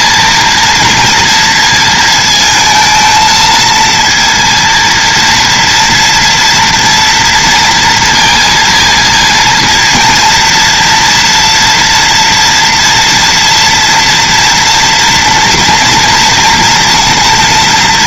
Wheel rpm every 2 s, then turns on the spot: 230, 220, 230, 230, 230, 230, 230, 230, 230.
none